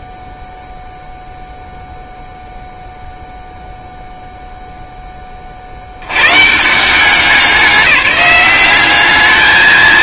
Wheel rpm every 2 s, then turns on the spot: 0, 0, 0, 170, 200.
none